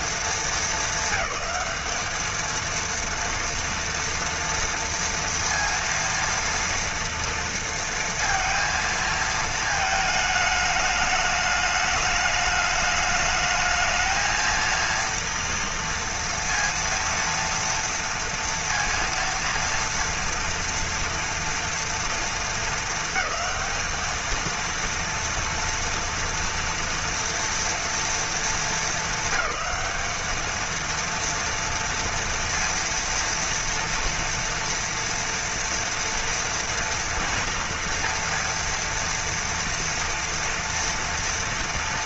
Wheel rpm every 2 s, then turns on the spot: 220, 220, 230, 230, 230, 220, 210, 220, 230, 230, 230, 230, 220, 230, 220, 210, 230, 230, 240, 230, 230.
none